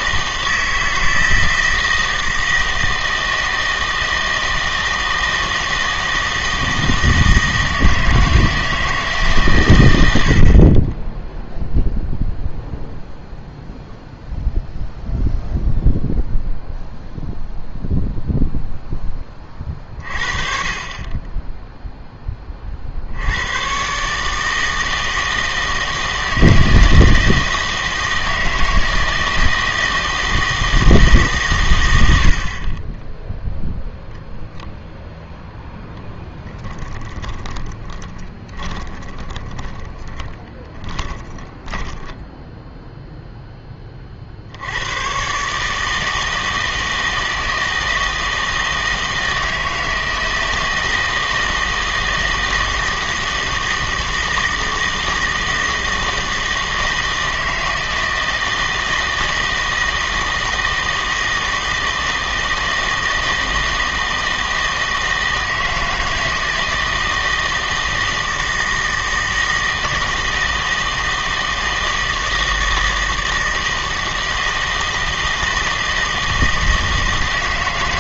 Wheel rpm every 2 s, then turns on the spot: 160, 160, 160, 160, 160, 40, 0, 0, 0, 0, 40, 40, 160, 160, 160, 160, 40, 10, 10, 20, 20, 0, 90, 160, 160, 160, 170, 160, 160, 160, 160, 160, 160, 160, 160, 160, 160, 160, 160.
36-42